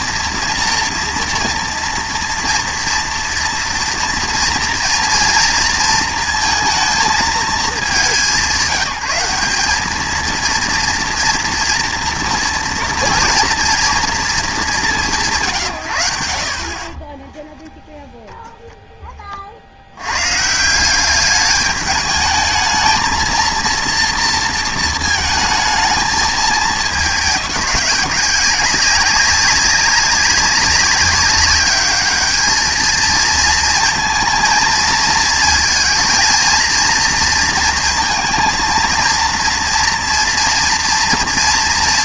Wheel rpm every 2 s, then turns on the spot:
230, 230, 230, 230, 200, 230, 240, 210, 40, 10, 200, 220, 220, 210, 190, 200, 220, 230, 240, 220, 230.
16-18